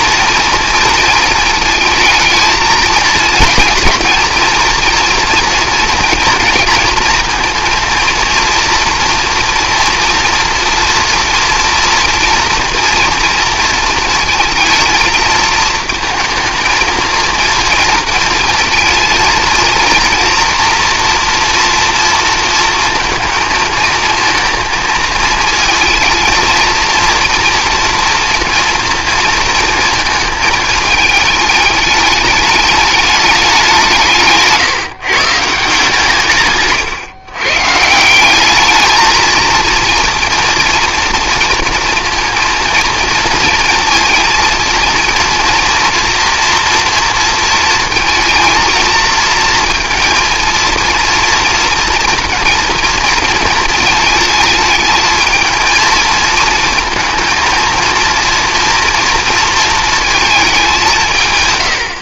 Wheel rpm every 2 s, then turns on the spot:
230, 220, 230, 230, 240, 240, 230, 230, 230, 230, 230, 230, 230, 230, 230, 220, 210, 150, 140, 210, 230, 230, 230, 240, 230, 230, 230, 220, 220, 230, 210.
none